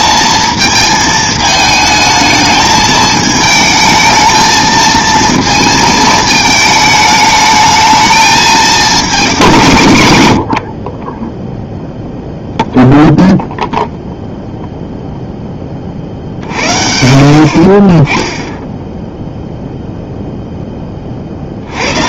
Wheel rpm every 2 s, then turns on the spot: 220, 220, 220, 220, 220, 70, 0, 0, 60, 10, 10.
none